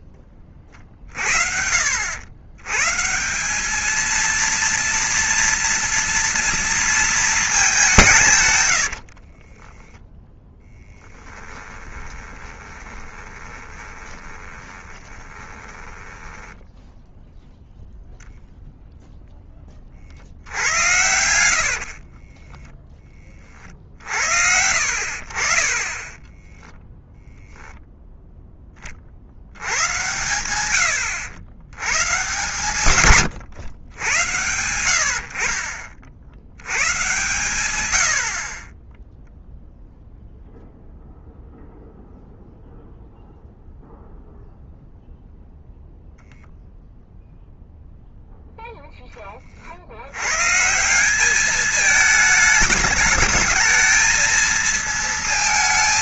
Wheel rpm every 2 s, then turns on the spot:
30, 150, 230, 230, 80, 10, 20, 20, 0, 0, 80, 10, 70, 0, 30, 100, 130, 80, 130, 10, 0, 0, 0, 0, 10, 180, 220, 230.
8-16 20-22